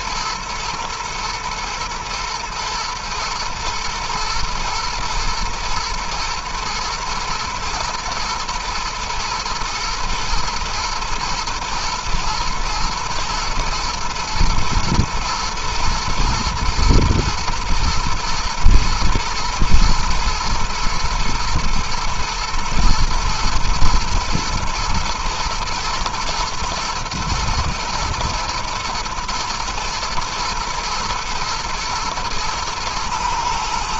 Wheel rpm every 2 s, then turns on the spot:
110, 120, 110, 110, 120, 120, 110, 110, 120, 110, 120, 120, 110, 110, 120, 120, 110.
none